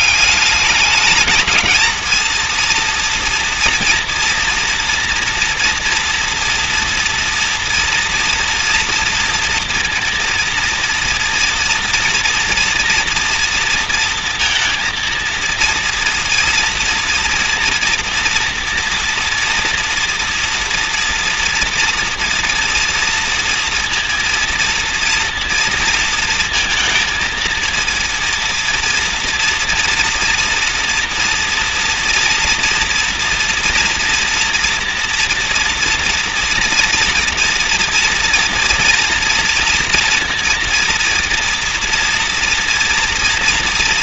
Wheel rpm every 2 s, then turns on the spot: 200, 230, 230, 230, 230, 230, 230, 230, 230, 230, 230, 240, 230, 230, 230, 240, 230, 230, 230, 230, 230, 230.
none